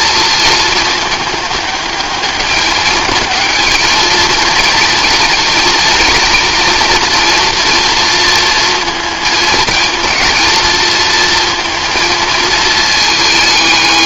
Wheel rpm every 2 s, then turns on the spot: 220, 210, 220, 230, 230, 230, 220.
none